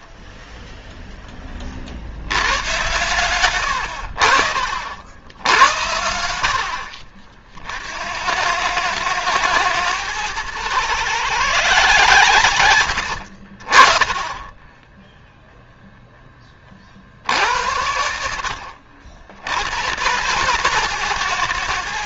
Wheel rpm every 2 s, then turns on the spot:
0, 110, 60, 60, 100, 120, 110, 10, 40, 60, 130.
12-14